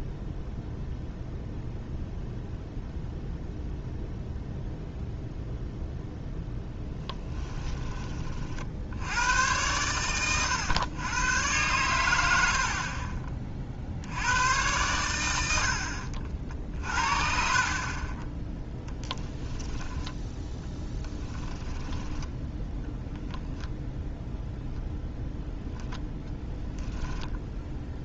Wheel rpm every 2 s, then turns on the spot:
0, 0, 0, 10, 70, 110, 30, 110, 50, 10, 10, 10, 0, 0.
6-8 12-14 16-18 20-22